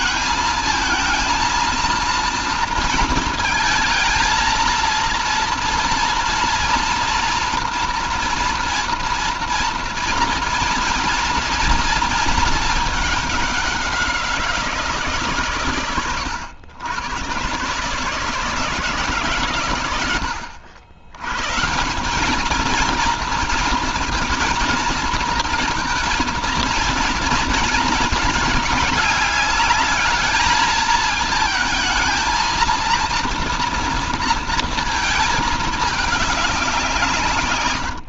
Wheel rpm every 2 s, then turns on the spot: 220, 230, 230, 230, 230, 240, 220, 170, 100, 160, 100, 220, 230, 230, 210, 220, 230, 230, 190.
none